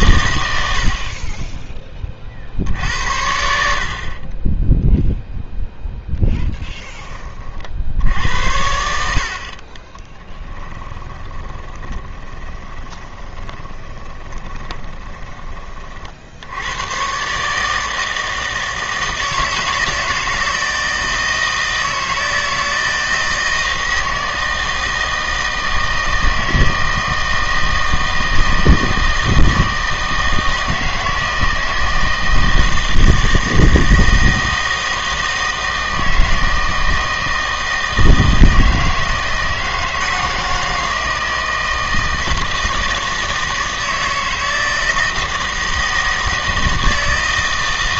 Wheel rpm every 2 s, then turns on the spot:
90, 70, 10, 10, 80, 10, 20, 20, 100, 160, 160, 160, 160, 160, 160, 160, 160, 160, 160, 160, 160, 160, 160, 160.
10-16